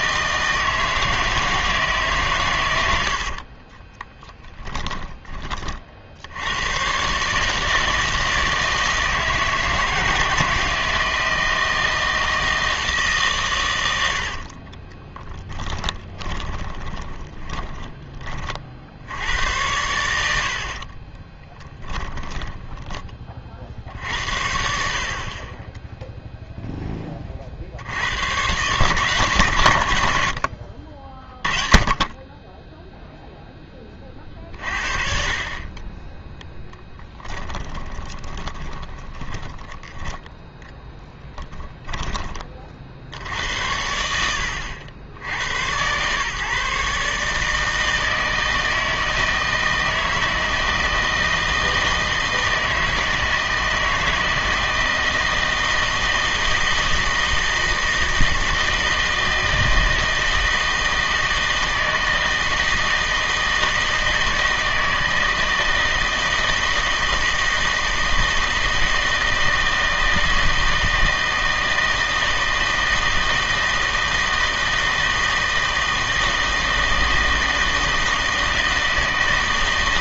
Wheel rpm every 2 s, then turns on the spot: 160, 100, 10, 100, 160, 160, 160, 50, 20, 50, 60, 20, 60, 0, 130, 60, 10, 40, 10, 20, 0, 40, 80, 150, 160, 160, 160, 160, 160, 160, 160, 160, 160, 160, 160, 160, 160, 160, 160, 160.
4-6 14-18 22-24 36-40